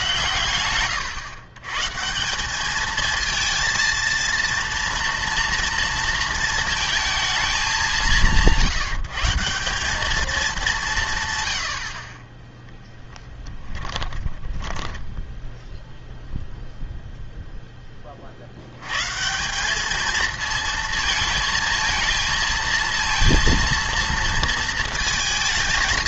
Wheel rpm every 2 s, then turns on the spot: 120, 210, 230, 230, 170, 200, 10, 10, 0, 100, 220, 230, 230.
14-16